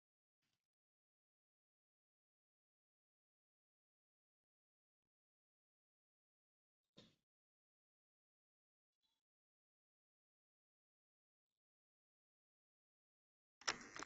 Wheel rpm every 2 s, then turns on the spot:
0, 0, 0, 0, 0, 0, 0.
none